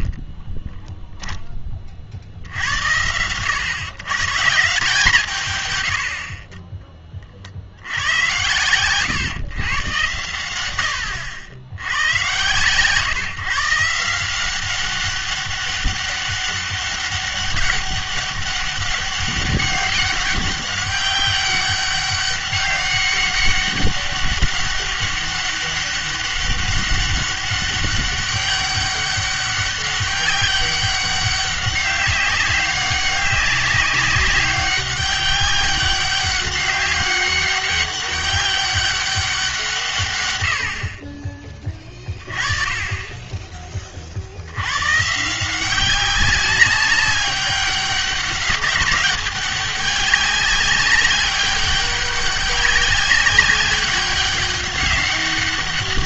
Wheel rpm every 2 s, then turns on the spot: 10, 80, 160, 40, 110, 110, 120, 190, 200, 200, 200, 200, 200, 200, 200, 200, 200, 200, 200, 200, 80, 30, 90, 200, 200, 200, 200, 200.
0-2